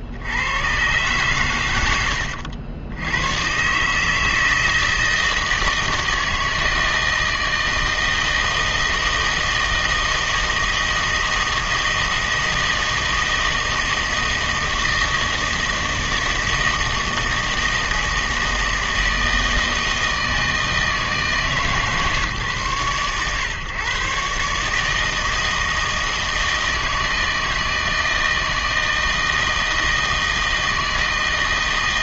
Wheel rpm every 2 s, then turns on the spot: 110, 90, 160, 160, 160, 160, 160, 160, 160, 160, 160, 120, 150, 160, 160, 160.
none